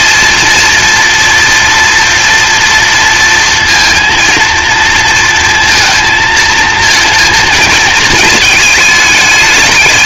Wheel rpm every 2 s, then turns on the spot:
240, 240, 230, 230, 210.
none